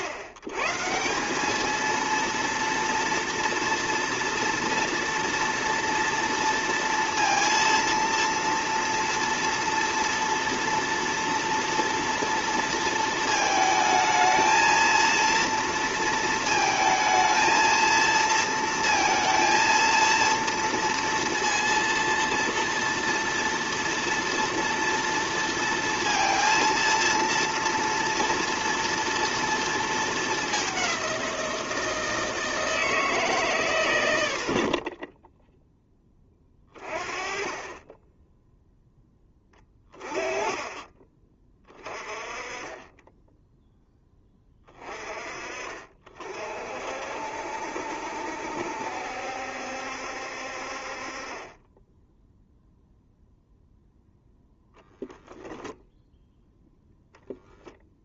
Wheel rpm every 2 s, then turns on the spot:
110, 230, 230, 230, 230, 230, 230, 230, 230, 230, 230, 230, 230, 230, 230, 200, 160, 60, 20, 0, 20, 20, 20, 50, 70, 60, 0, 0, 0.
34-36 40-42